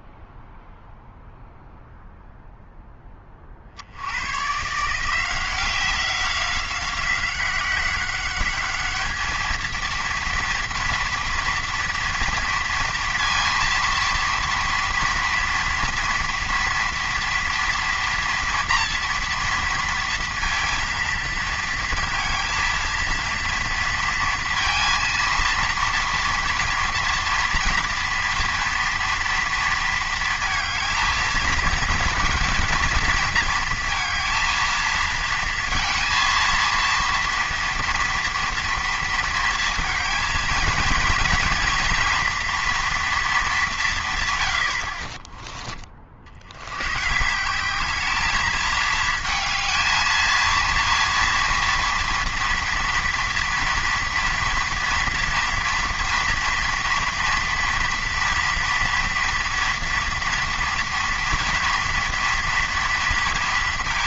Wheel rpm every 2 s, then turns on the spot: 0, 0, 140, 190, 200, 230, 230, 230, 230, 230, 230, 230, 230, 240, 230, 230, 230, 230, 230, 230, 230, 240, 90, 90, 210, 230, 230, 230, 230, 240, 240, 230.
none